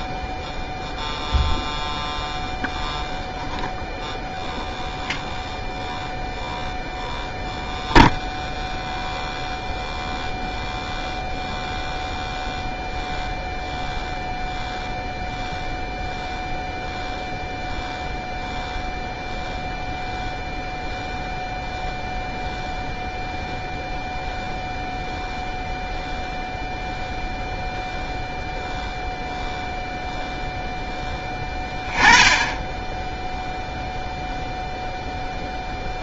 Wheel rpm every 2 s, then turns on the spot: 0, 0, 0, 0, 0, 0, 0, 0, 0, 0, 0, 0, 0, 0, 0, 0, 10, 0.
none